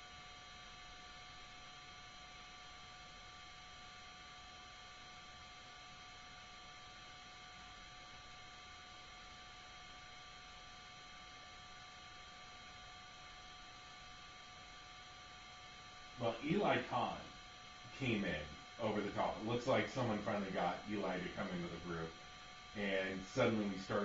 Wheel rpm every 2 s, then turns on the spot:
0, 0, 0, 0, 0, 0, 0, 0, 0, 0, 0, 0.
none